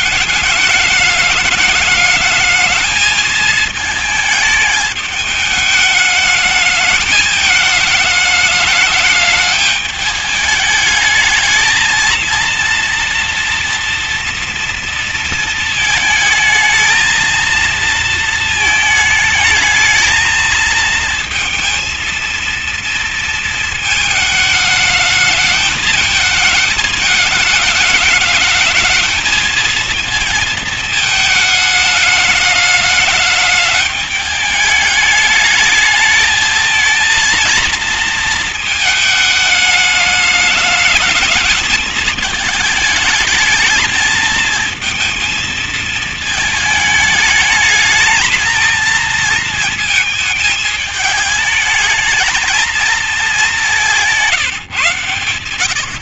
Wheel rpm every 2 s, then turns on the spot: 210, 220, 210, 210, 210, 210, 230, 230, 220, 220, 220, 230, 210, 220, 210, 220, 210, 210, 220, 220, 220, 220, 220, 220, 230, 220, 220, 140.
none